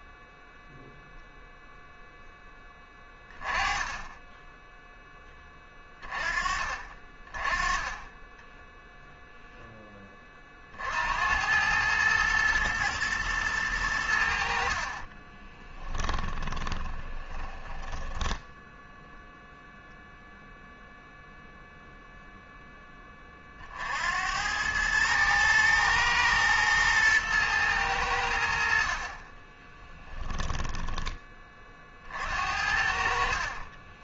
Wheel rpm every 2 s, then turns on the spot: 0, 10, 10, 30, 10, 50, 120, 50, 20, 0, 0, 10, 100, 110, 50, 10, 60.
8-10 14-18 30-32